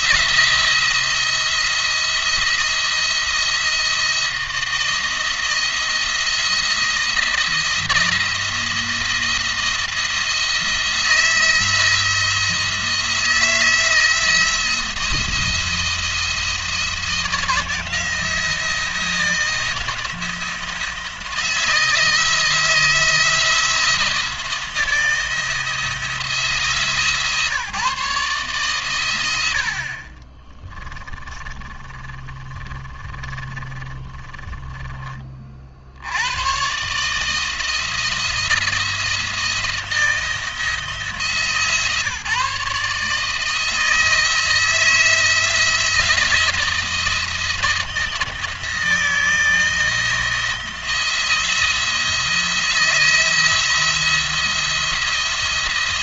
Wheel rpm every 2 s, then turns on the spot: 170, 170, 170, 170, 170, 170, 170, 170, 170, 170, 170, 160, 160, 150, 130, 20, 30, 30, 120, 170, 170, 150, 160, 170, 160, 170, 170, 170.
30-36